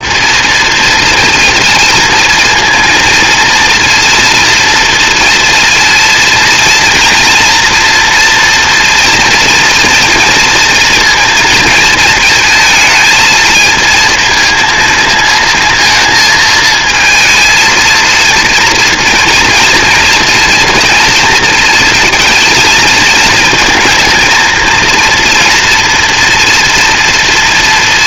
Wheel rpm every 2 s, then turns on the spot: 230, 230, 230, 240, 240, 230, 220, 220, 220, 230, 220, 220, 240, 230.
none